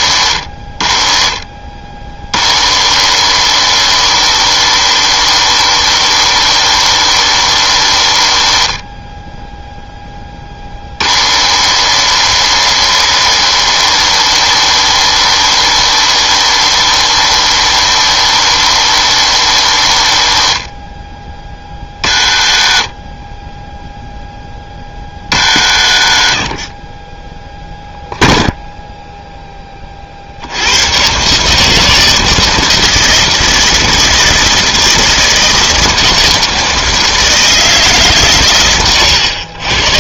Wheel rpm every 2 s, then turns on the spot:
40, 70, 100, 100, 50, 40, 100, 100, 100, 100, 40, 40, 20, 40, 0, 80, 160, 160, 160, 120.
none